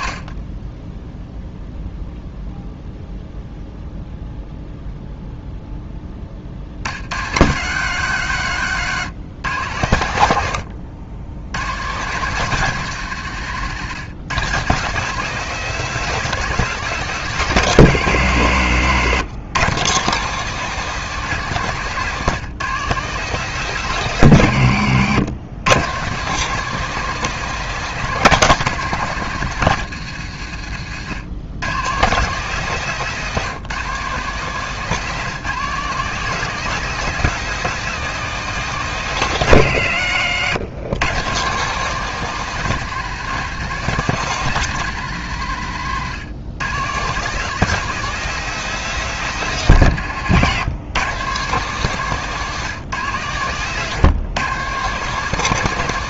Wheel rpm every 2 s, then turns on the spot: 20, 0, 0, 60, 130, 90, 160, 170, 190, 130, 180, 180, 120, 190, 180, 100, 170, 170, 190, 180, 120, 180, 180, 140, 190, 140, 160, 150.
30-32